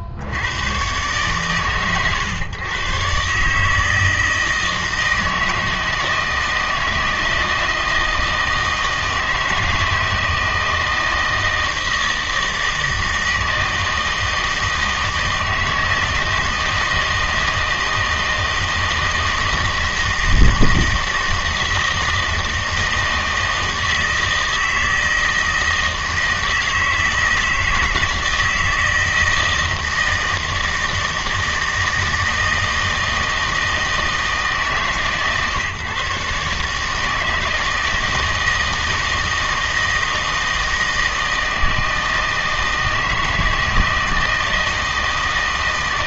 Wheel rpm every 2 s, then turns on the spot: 110, 120, 160, 160, 160, 160, 160, 160, 160, 160, 160, 160, 160, 160, 160, 160, 160, 150, 150, 160, 160, 160, 160.
none